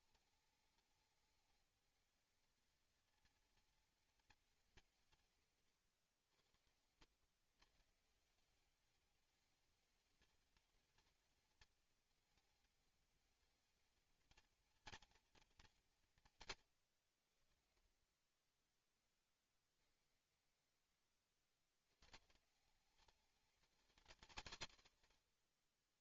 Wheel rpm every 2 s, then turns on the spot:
210, 230, 170, 90, 210, 210, 220, 220, 120, 10, 20, 170, 150.
18-20